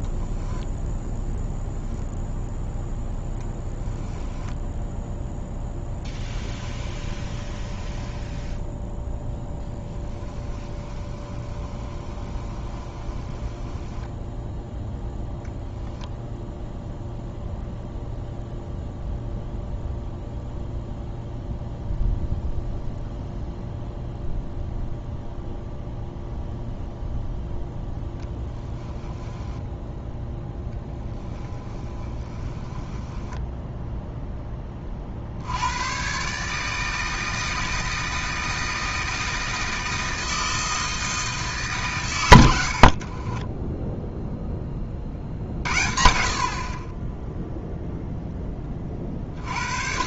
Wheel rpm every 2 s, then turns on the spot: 0, 0, 0, 10, 0, 20, 20, 0, 0, 0, 0, 0, 0, 0, 10, 10, 20, 30, 160, 160, 160, 70, 30, 40, 20.
6-8 10-14 30-34 42-44